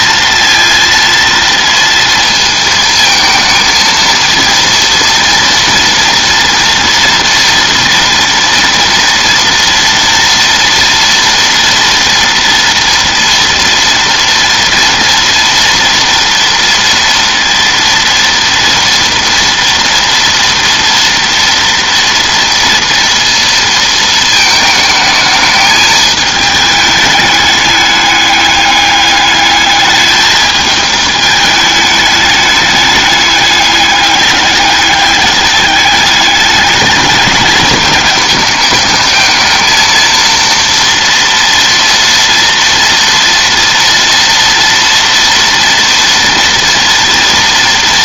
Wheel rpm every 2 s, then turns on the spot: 230, 220, 230, 230, 230, 230, 230, 230, 230, 230, 230, 230, 220, 210, 200, 210, 210, 210, 210, 220, 230, 230, 230, 230.
none